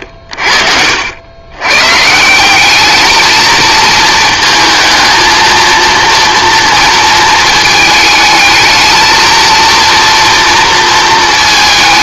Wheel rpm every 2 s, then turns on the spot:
70, 210, 220, 230, 220, 230.
none